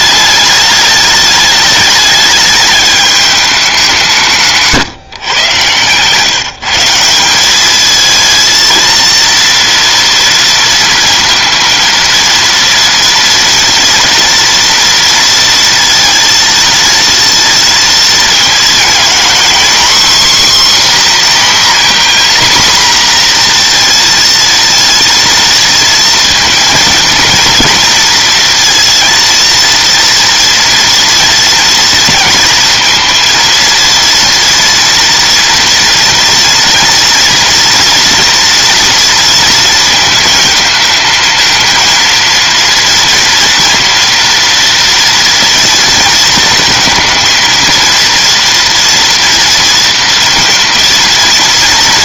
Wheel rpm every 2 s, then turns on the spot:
210, 210, 160, 160, 220, 230, 230, 230, 230, 230, 270, 250, 230, 230, 230, 230, 230, 230, 230, 230, 220, 230, 230, 230, 240, 230.
none